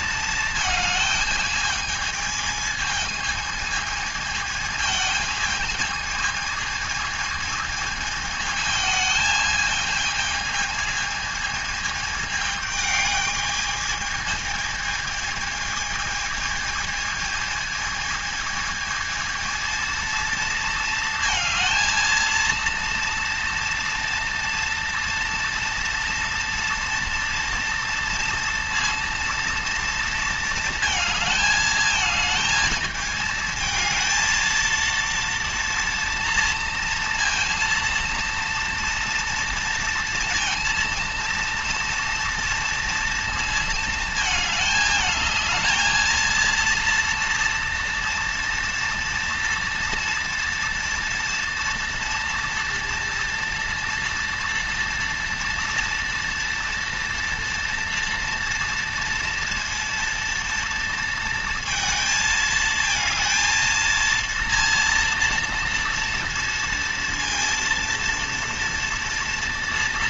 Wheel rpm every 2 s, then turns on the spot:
220, 220, 220, 220, 220, 220, 220, 220, 220, 220, 230, 230, 230, 230, 230, 230, 220, 230, 230, 230, 230, 230, 220, 230, 230, 230, 230, 230, 230, 230, 230, 220, 230, 230, 230.
none